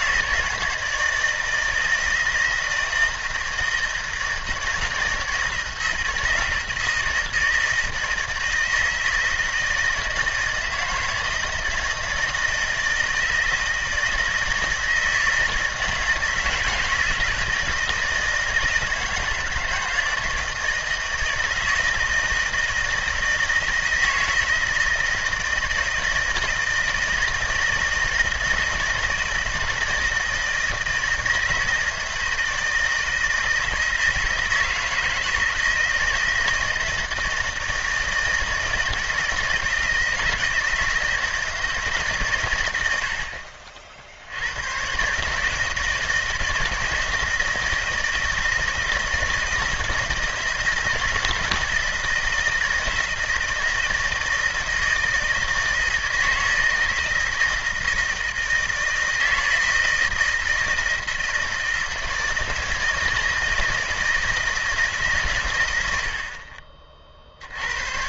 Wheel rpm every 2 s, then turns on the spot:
160, 160, 160, 160, 160, 160, 160, 160, 160, 160, 160, 160, 160, 160, 160, 160, 160, 160, 160, 160, 160, 110, 100, 160, 160, 160, 160, 160, 160, 160, 160, 160, 160, 30.
none